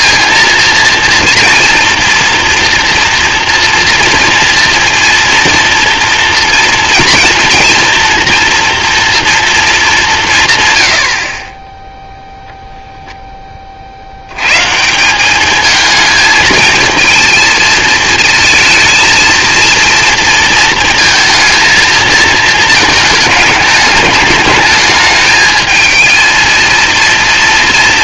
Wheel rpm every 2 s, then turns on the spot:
230, 240, 240, 230, 240, 110, 0, 130, 220, 230, 230, 220, 220, 230.
none